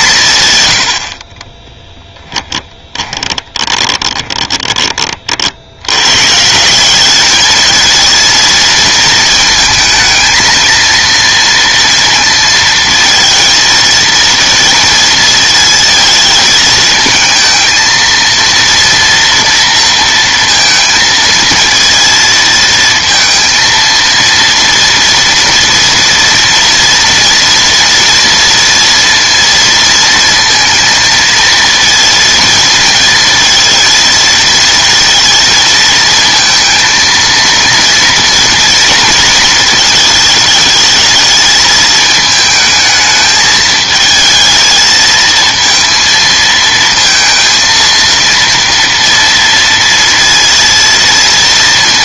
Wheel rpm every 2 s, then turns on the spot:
90, 10, 20, 170, 230, 230, 230, 230, 220, 230, 230, 230, 230, 230, 230, 230, 230, 230, 230, 230, 220, 220, 220, 230, 230, 230.
2-4